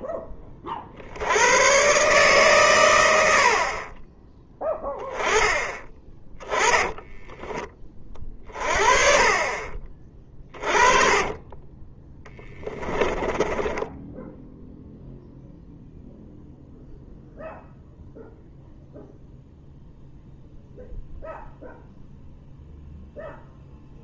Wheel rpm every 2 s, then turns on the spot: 50, 110, 10, 10, 30, 30, 10, 0, 0, 0, 0, 0.
6-8 10-14